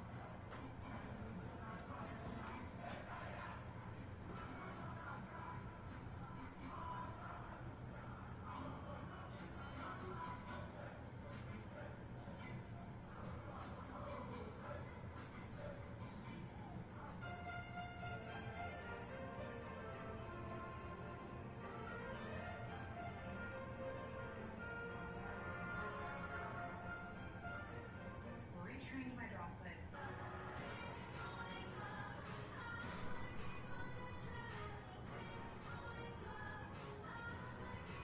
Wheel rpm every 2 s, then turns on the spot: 0, 0, 0, 0, 0, 0, 0, 0, 0, 0, 0, 0, 0, 0, 0, 0, 0, 0, 0.
none